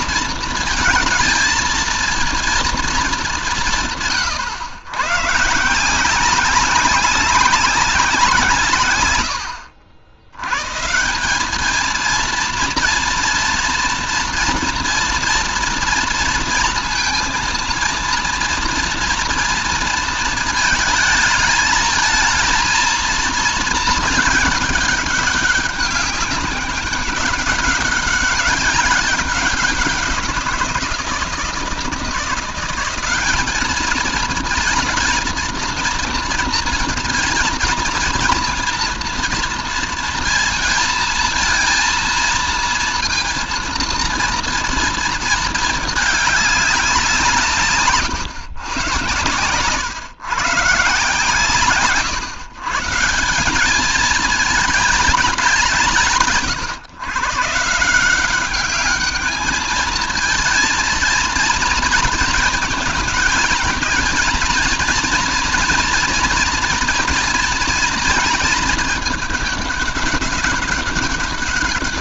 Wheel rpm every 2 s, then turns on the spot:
230, 230, 120, 190, 150, 130, 230, 230, 230, 230, 230, 220, 210, 200, 200, 180, 180, 220, 230, 230, 230, 230, 230, 200, 110, 130, 140, 220, 150, 200, 230, 220, 230, 230, 230, 200.
none